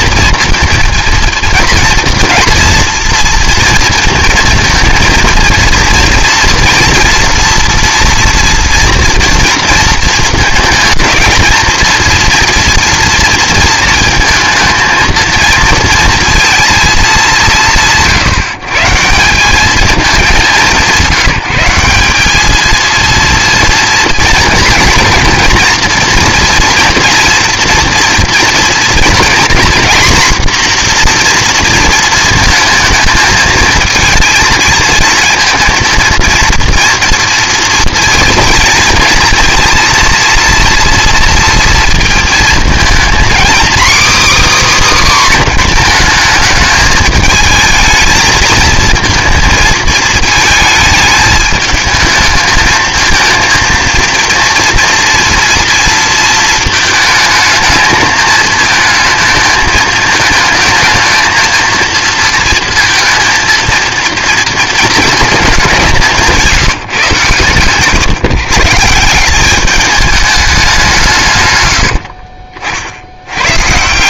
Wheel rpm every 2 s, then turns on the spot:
230, 230, 230, 240, 230, 220, 230, 230, 230, 150, 180, 220, 230, 230, 230, 240, 220, 230, 230, 230, 230, 230, 290, 220, 220, 220, 220, 230, 220, 230, 220, 230, 230, 180, 160, 200, 50.
none